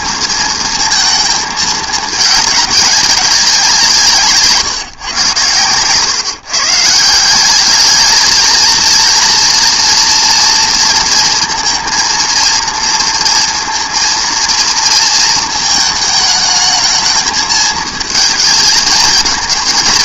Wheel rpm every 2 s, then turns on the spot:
230, 210, 160, 140, 220, 230, 230, 230, 220, 220.
none